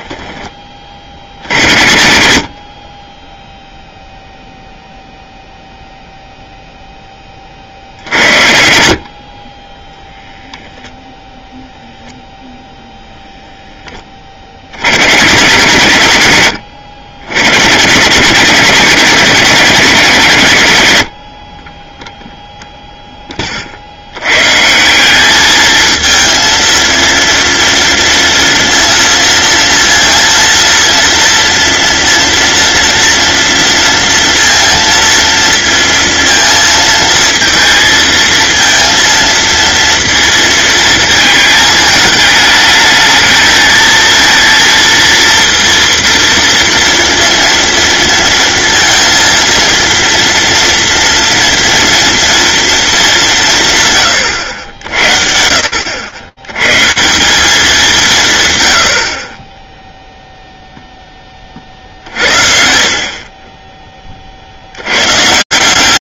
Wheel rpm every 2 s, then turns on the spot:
30, 60, 0, 0, 80, 0, 0, 60, 90, 170, 130, 0, 140, 230, 230, 230, 230, 230, 230, 230, 230, 220, 230, 230, 230, 230, 230, 80, 130, 90, 0, 60, 110.
none